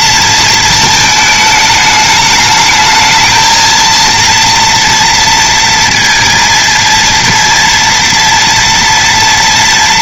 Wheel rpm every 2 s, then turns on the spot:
220, 210, 230, 230, 230.
none